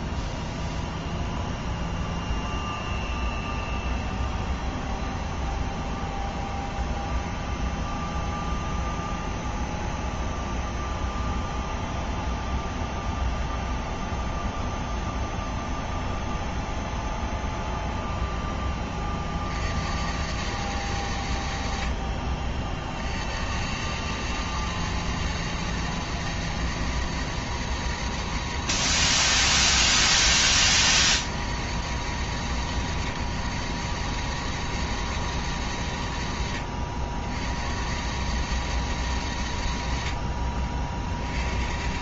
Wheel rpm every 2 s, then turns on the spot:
0, 0, 0, 0, 0, 0, 0, 0, 0, 10, 100, 40, 110, 110, 100, 80, 90, 110, 70, 110, 60.
none